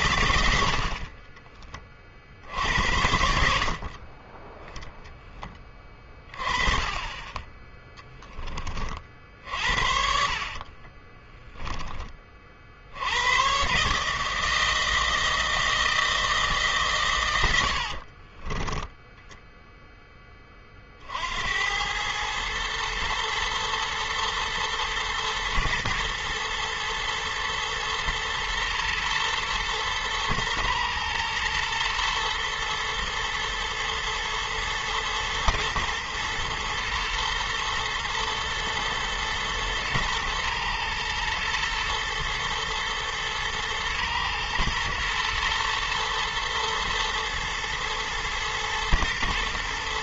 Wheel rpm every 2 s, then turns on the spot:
40, 80, 10, 20, 40, 20, 80, 160, 120, 10, 60, 110, 110, 120, 120, 120, 110, 110, 110, 120, 110, 120, 120, 110, 120.
10-12 18-20